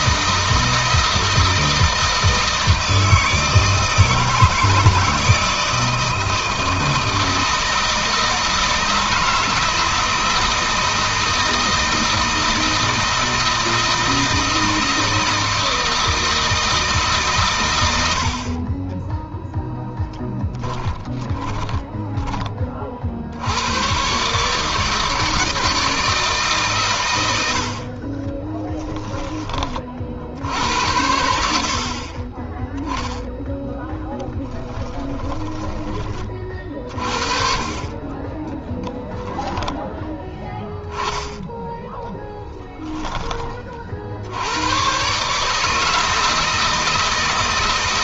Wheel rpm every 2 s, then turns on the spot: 160, 160, 160, 160, 160, 160, 160, 160, 160, 40, 20, 20, 140, 140, 20, 70, 20, 10, 30, 10, 10, 10, 100, 160.
18-22 28-30 34-36 38-40